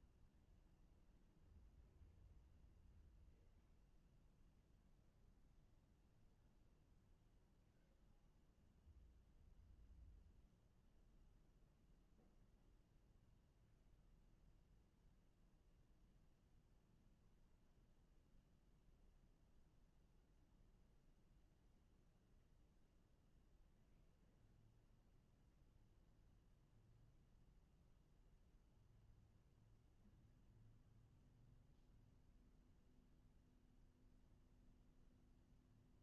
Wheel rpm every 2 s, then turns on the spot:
0, 0, 0, 0, 0, 0, 0, 0, 0, 0, 0, 0, 0, 0, 0, 0, 0, 0.
none